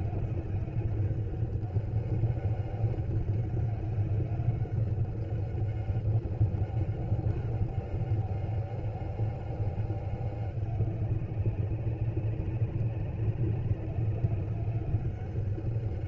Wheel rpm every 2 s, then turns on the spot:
190, 190, 190, 200, 200, 190, 190, 200.
none